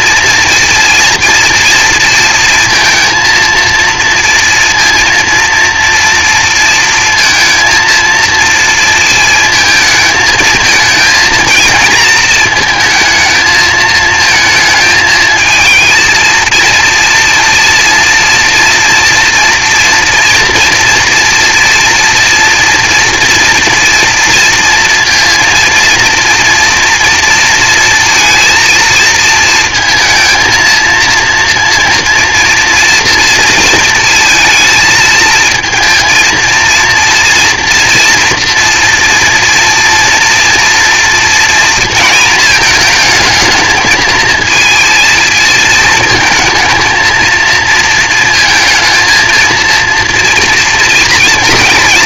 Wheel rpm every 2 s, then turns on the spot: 230, 230, 230, 230, 230, 220, 220, 220, 230, 230, 230, 230, 230, 230, 230, 230, 230, 230, 230, 230, 230, 220, 230, 220, 220, 230.
none